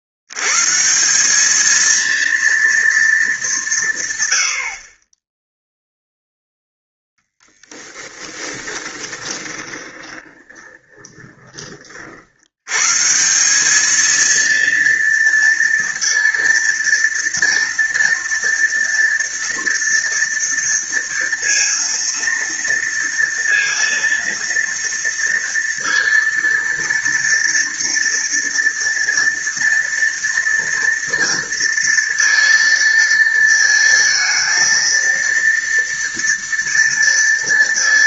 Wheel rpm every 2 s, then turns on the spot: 130, 230, 70, 0, 20, 20, 100, 230, 230, 230, 230, 230, 230, 230, 230, 230, 230, 230, 230.
8-12